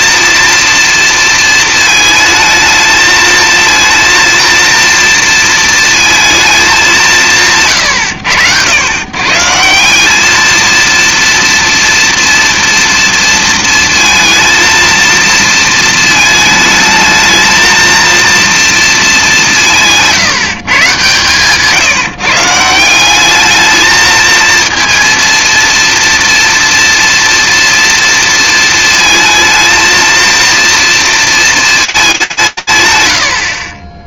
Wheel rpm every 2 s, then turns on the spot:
230, 220, 230, 220, 90, 220, 230, 230, 220, 230, 140, 170, 230, 230, 230, 230, 140.
none